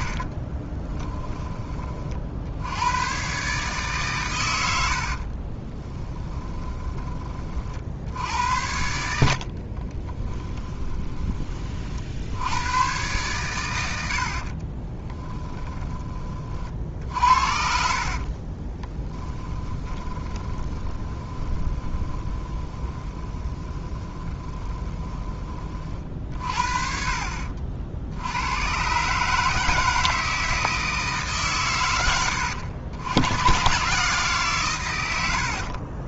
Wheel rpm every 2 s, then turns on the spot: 10, 90, 100, 20, 80, 10, 100, 30, 50, 20, 20, 20, 20, 40, 120, 160, 100, 110.
0-2 6-8 10-12 14-16 18-26